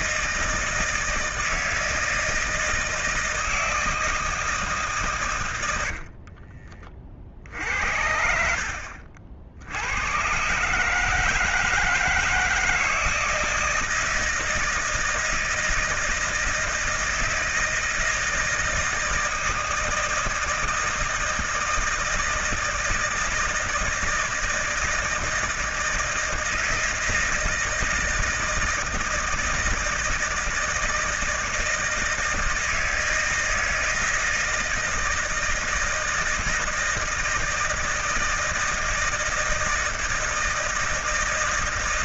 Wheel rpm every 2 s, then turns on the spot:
160, 160, 150, 30, 60, 130, 160, 160, 160, 160, 160, 160, 160, 160, 160, 160, 160, 160, 160, 160, 160.
none